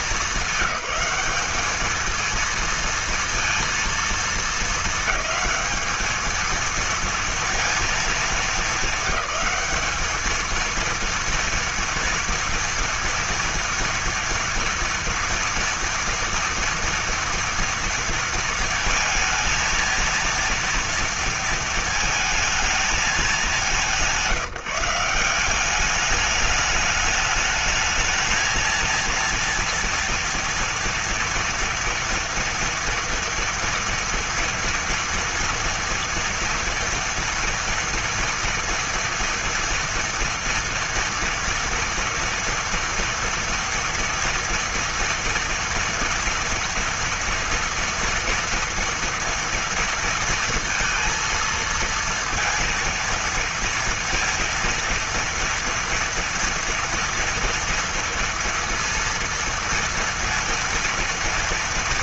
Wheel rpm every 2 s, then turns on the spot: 200, 230, 220, 230, 200, 220, 230, 230, 230, 230, 230, 220, 170, 210, 230, 230, 230, 230, 230, 230, 230, 230, 230, 230, 230, 230, 230, 230, 230, 230, 230.
none